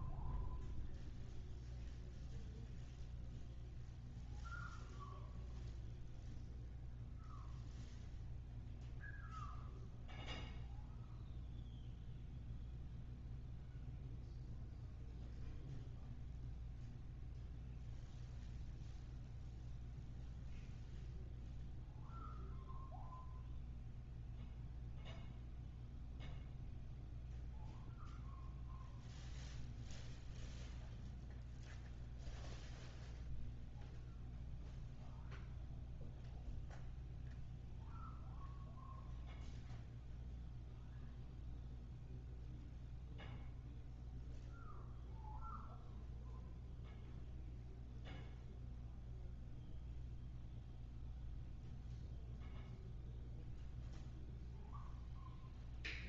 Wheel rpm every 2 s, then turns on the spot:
0, 0, 0, 0, 0, 0, 0, 0, 0, 0, 0, 0, 0, 0, 0, 0, 0, 0, 0, 0, 0, 0, 0, 0, 0, 0, 0, 0.
none